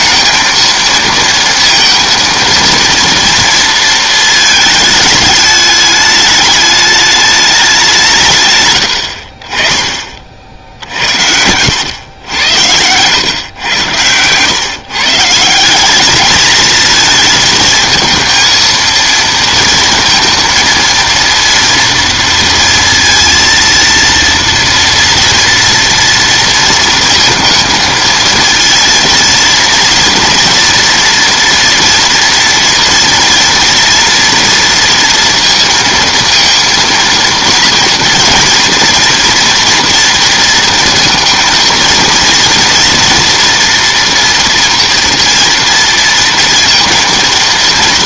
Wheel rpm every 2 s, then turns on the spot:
230, 230, 220, 210, 120, 60, 100, 120, 220, 230, 230, 230, 230, 230, 230, 230, 230, 230, 230, 230, 230, 230, 230, 230.
none